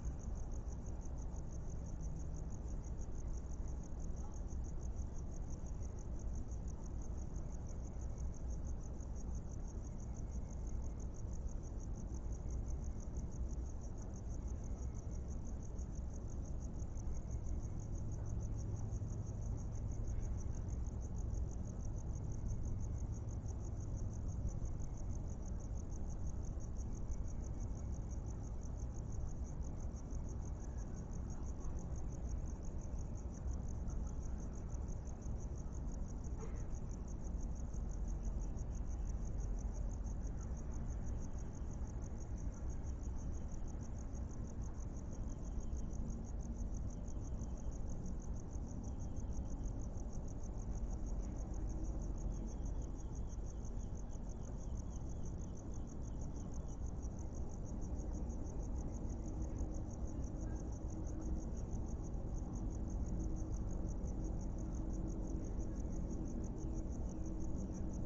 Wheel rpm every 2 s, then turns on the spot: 0, 0, 0, 0, 0, 0, 0, 0, 0, 0, 0, 0, 0, 0, 0, 0, 0, 0, 0, 0, 0, 0, 0, 0, 0, 0, 0, 0, 0, 0, 0, 0, 0, 0.
none